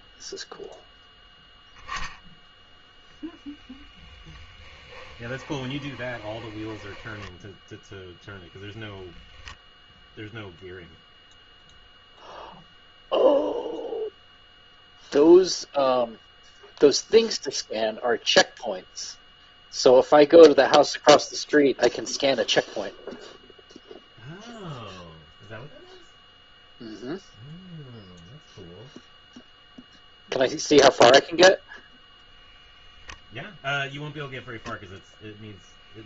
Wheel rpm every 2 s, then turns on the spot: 0, 0, 10, 10, 0, 0, 0, 0, 0, 0, 0, 0, 0, 0, 0, 0, 0, 0.
4-8